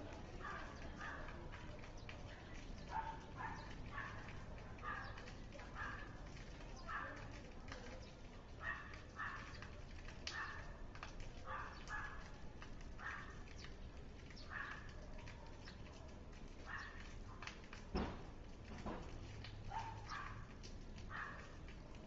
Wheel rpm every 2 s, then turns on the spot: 0, 0, 0, 0, 0, 0, 0, 0, 0, 0, 0.
none